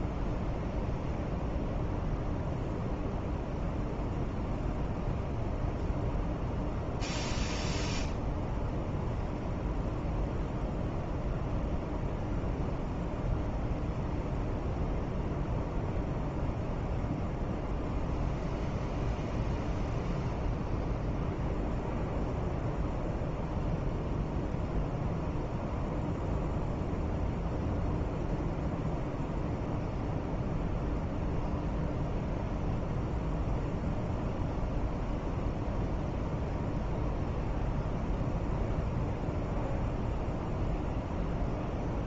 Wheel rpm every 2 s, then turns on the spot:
0, 0, 0, 0, 0, 0, 0, 0, 0, 0, 0, 0, 0, 0, 0, 0, 0, 0, 0, 0, 0.
none